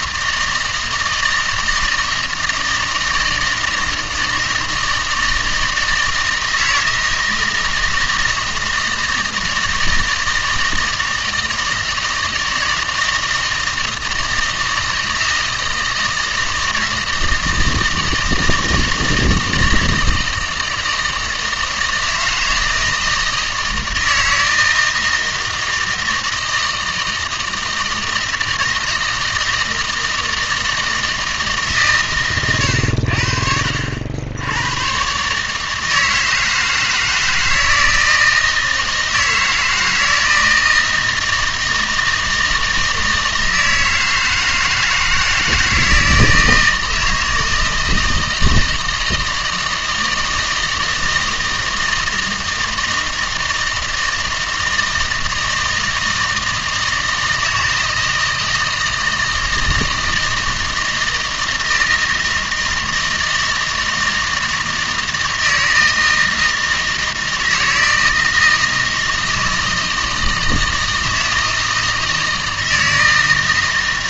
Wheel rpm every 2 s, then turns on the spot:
160, 160, 160, 160, 160, 160, 170, 160, 160, 160, 160, 160, 160, 160, 160, 160, 100, 110, 160, 160, 160, 160, 160, 160, 160, 160, 160, 160, 160, 160, 160, 160, 160, 160, 160, 160, 160.
none